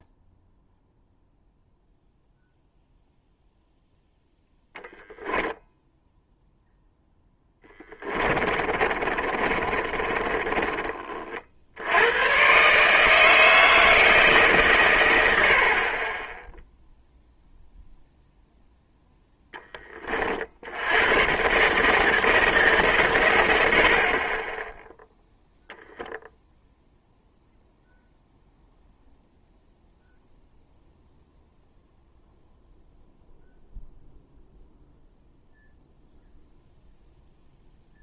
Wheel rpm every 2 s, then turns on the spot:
0, 0, 0, 0, 30, 30, 140, 130, 0, 0, 80, 150, 10, 0, 0, 0, 0, 0, 0.
8-12